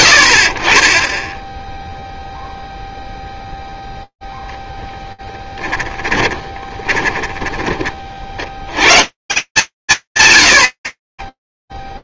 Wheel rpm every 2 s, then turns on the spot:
70, 0, 10, 20, 140, 30.
6-8